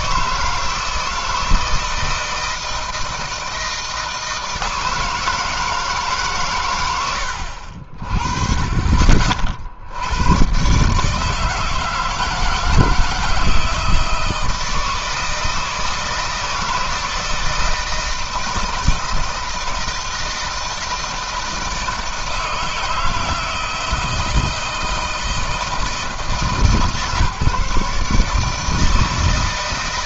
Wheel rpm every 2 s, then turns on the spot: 160, 160, 160, 140, 40, 120, 160, 160, 160, 160, 160, 160, 160, 150, 160.
none